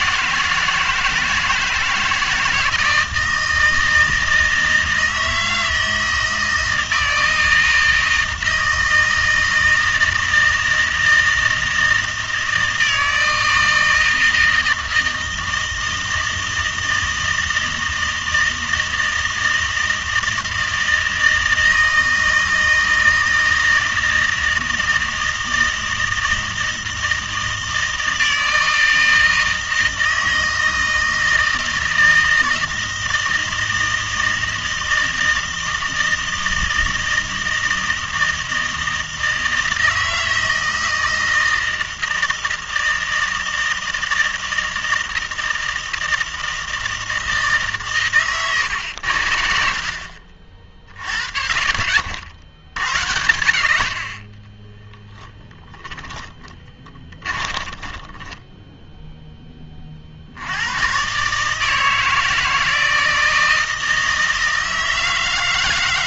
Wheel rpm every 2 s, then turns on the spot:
160, 160, 160, 160, 160, 160, 160, 160, 160, 160, 160, 160, 160, 160, 160, 160, 160, 160, 160, 160, 160, 160, 160, 160, 120, 50, 70, 10, 20, 10, 90, 160, 160.
50-52 54-60